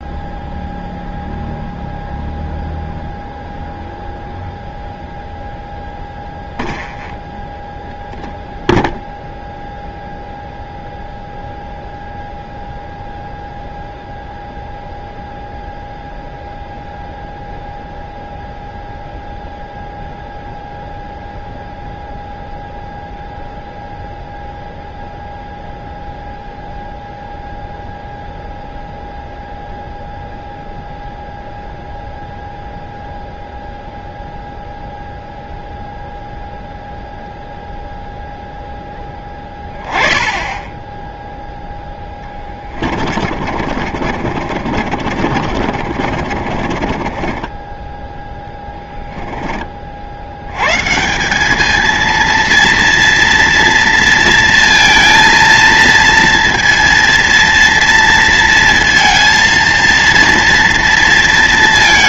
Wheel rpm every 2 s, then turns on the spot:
0, 0, 0, 0, 0, 0, 0, 0, 0, 0, 0, 0, 0, 0, 0, 0, 0, 0, 0, 0, 10, 0, 40, 50, 20, 40, 220, 230, 230, 230, 230.
44-50